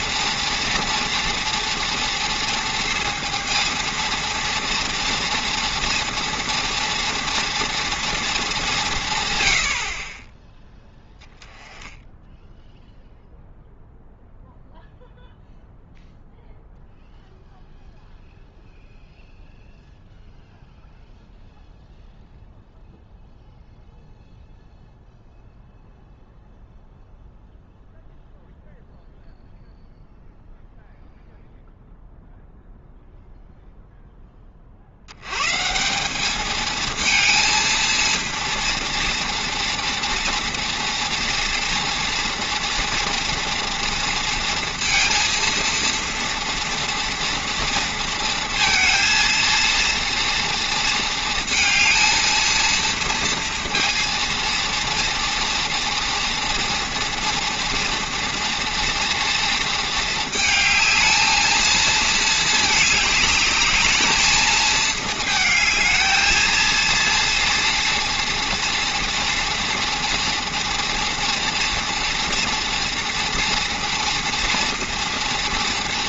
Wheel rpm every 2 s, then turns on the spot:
230, 230, 230, 240, 190, 10, 0, 0, 0, 0, 0, 0, 0, 0, 0, 0, 0, 40, 220, 230, 230, 230, 230, 230, 230, 230, 230, 230, 230, 230, 220, 220, 220, 230, 230, 230, 230, 230.
none